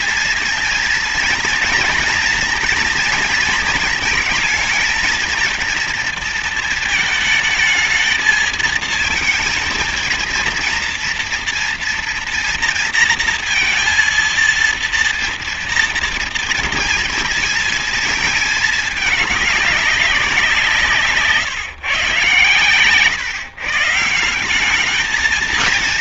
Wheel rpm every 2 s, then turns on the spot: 230, 230, 230, 220, 220, 230, 230, 230, 230, 220, 170, 130, 200.
none